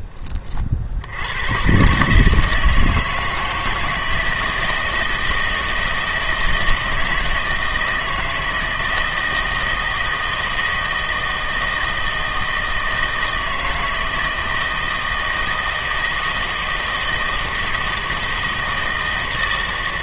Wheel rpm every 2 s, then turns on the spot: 60, 160, 160, 160, 160, 160, 160, 160, 160, 160.
none